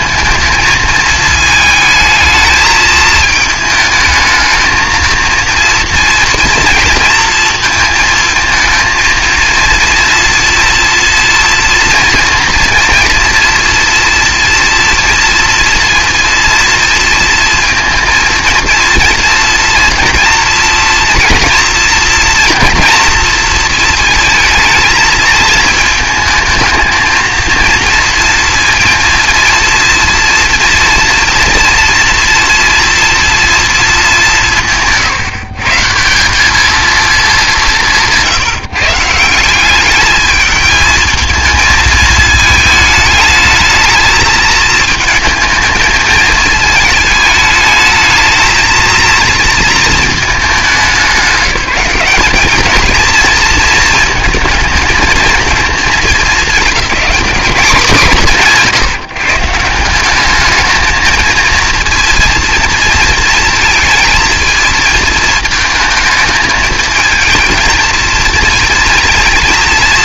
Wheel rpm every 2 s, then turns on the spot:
220, 220, 220, 230, 220, 230, 230, 240, 230, 240, 230, 230, 220, 220, 230, 240, 230, 180, 210, 160, 220, 220, 220, 220, 230, 210, 200, 230, 210, 150, 210, 230, 220, 220, 230.
none